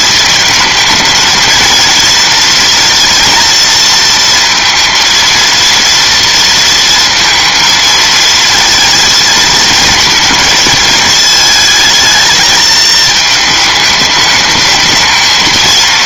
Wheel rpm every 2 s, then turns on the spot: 220, 230, 230, 230, 230, 220, 220, 220.
none